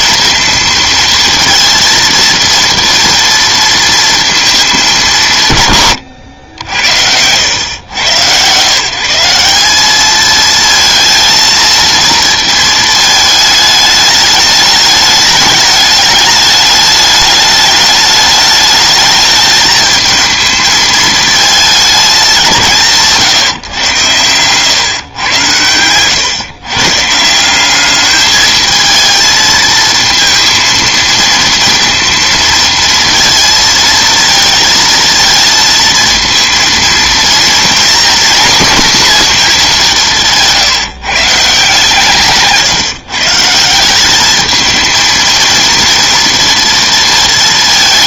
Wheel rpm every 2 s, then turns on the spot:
230, 230, 220, 90, 120, 220, 230, 210, 210, 210, 220, 190, 110, 130, 220, 230, 230, 230, 230, 250, 160, 140, 220, 230.
6-8 42-44